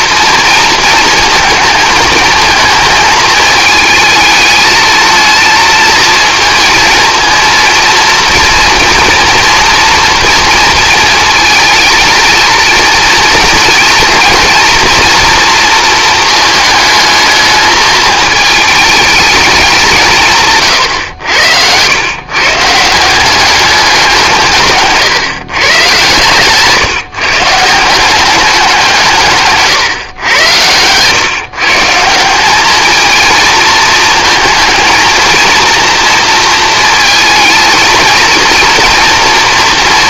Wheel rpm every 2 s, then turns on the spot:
230, 220, 220, 230, 230, 230, 230, 230, 220, 220, 140, 140, 150, 140, 180, 100, 200, 230, 230, 230.
30-32